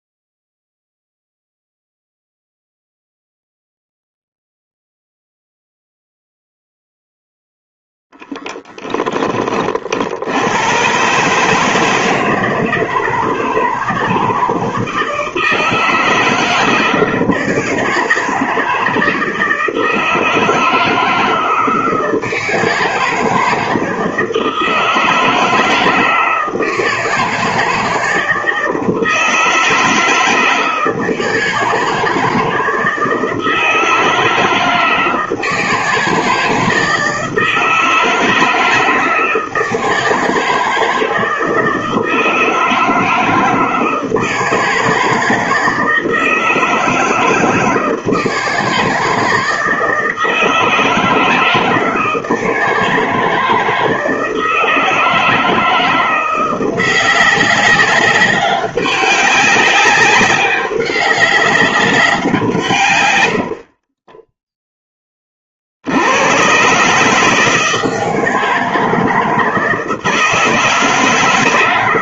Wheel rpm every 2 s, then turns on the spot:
0, 0, 0, 0, 10, 100, 160, 160, 160, 160, 160, 160, 160, 160, 160, 160, 160, 160, 170, 160, 160, 160, 160, 160, 160, 160, 160, 160, 180, 200, 200, 160, 10, 120, 160, 160.
64-66